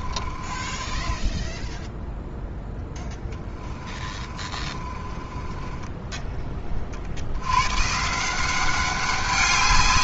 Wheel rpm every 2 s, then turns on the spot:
20, 0, 30, 30, 190.
0-2 4-6